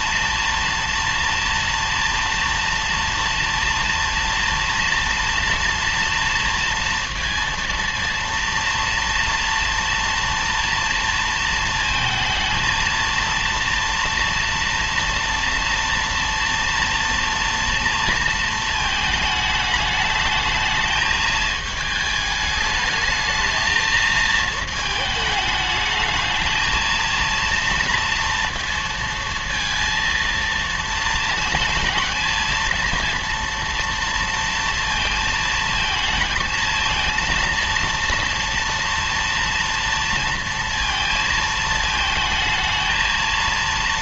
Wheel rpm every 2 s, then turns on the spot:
230, 230, 230, 230, 230, 230, 230, 230, 230, 220, 220, 210, 220, 220, 230, 230, 220, 230, 230, 230, 230, 220.
none